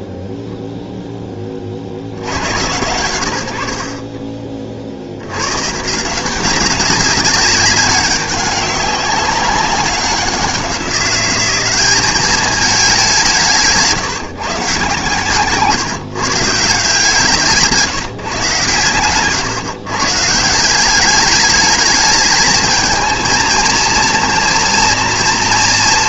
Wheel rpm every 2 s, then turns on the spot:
0, 80, 30, 180, 200, 180, 210, 150, 150, 140, 170, 220, 230.
none